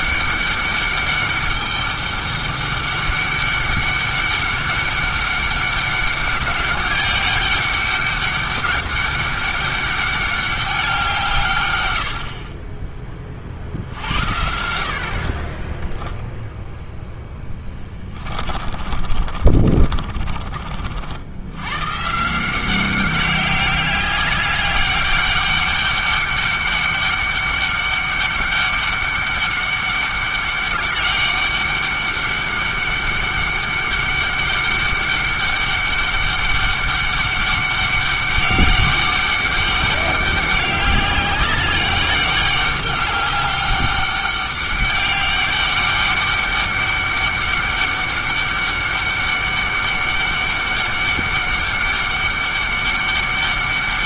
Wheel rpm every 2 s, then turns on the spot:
200, 200, 200, 200, 200, 200, 30, 70, 0, 30, 40, 180, 200, 200, 200, 200, 200, 200, 200, 200, 190, 200, 200, 200, 200, 200, 200.
18-20